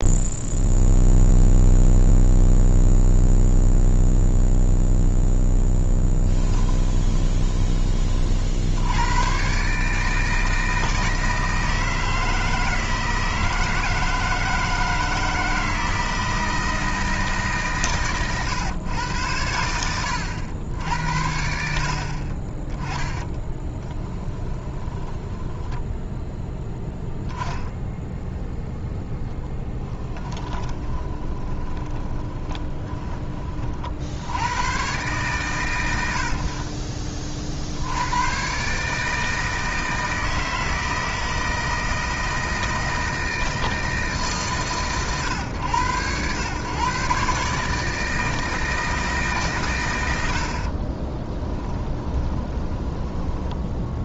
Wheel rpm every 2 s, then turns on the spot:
0, 0, 0, 20, 80, 160, 160, 160, 160, 120, 80, 20, 20, 0, 0, 20, 20, 110, 40, 140, 160, 160, 140, 130, 160, 50, 20.
6-8 22-26 30-34 50-54